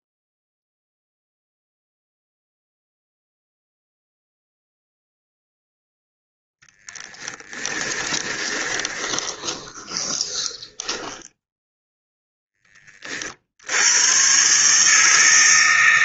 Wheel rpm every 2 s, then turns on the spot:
0, 0, 0, 10, 20, 10, 30, 150.
8-12